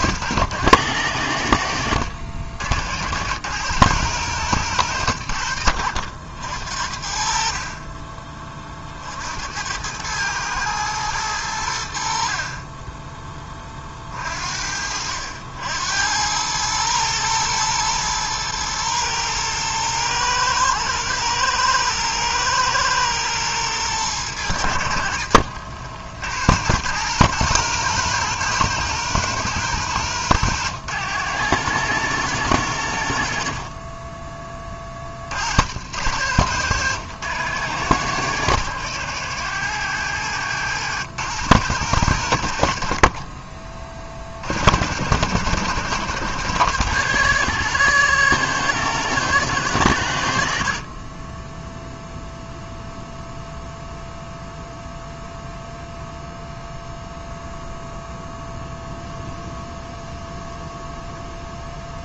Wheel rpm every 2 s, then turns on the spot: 110, 70, 120, 70, 30, 110, 40, 50, 100, 110, 110, 110, 100, 90, 130, 110, 110, 20, 110, 110, 110, 80, 60, 100, 120, 60, 0, 0, 0, 0, 0.
none